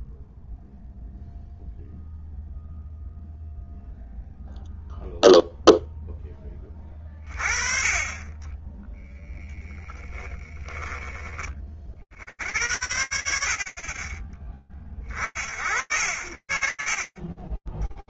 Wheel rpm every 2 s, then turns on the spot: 0, 0, 0, 30, 10, 30, 30, 60, 0.
8-10